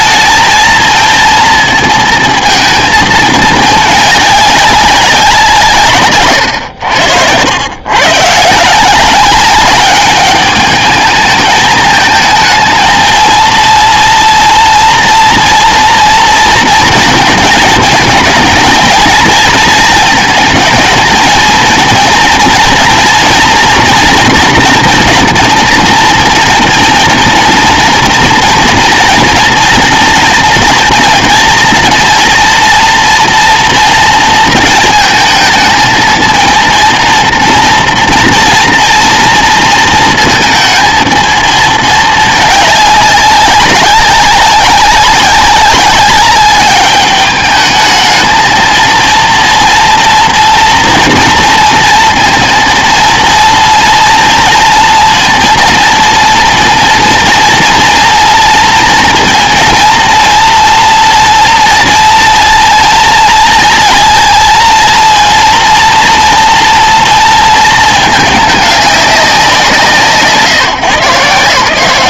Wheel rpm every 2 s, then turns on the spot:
230, 220, 200, 100, 170, 210, 220, 230, 230, 230, 220, 230, 230, 230, 230, 230, 230, 220, 230, 230, 230, 200, 200, 200, 230, 230, 230, 230, 230, 230, 240, 230, 230, 230, 200, 150.
6-8